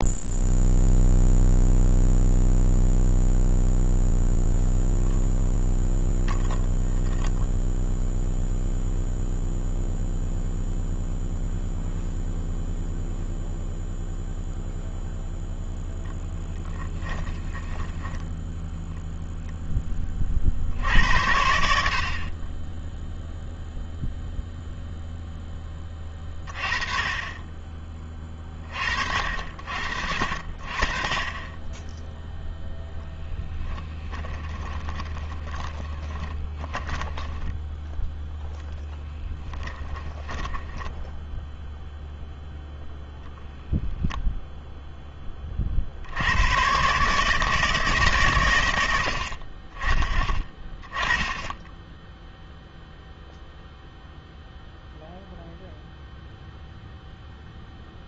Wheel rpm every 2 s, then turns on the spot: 0, 0, 0, 0, 0, 0, 0, 0, 10, 0, 70, 10, 0, 30, 40, 40, 10, 20, 10, 10, 10, 0, 10, 120, 80, 10, 0, 0, 0.
16-18 34-38 40-42